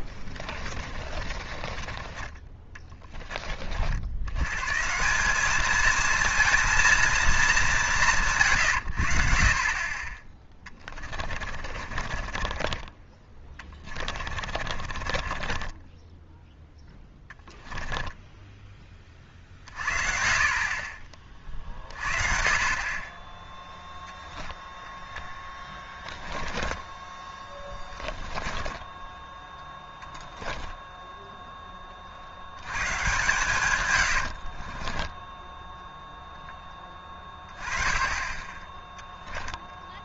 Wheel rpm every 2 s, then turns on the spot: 20, 10, 130, 230, 130, 20, 30, 40, 10, 20, 40, 50, 0, 20, 10, 10, 100, 40, 10, 20.
0-2 10-18 26-32 34-36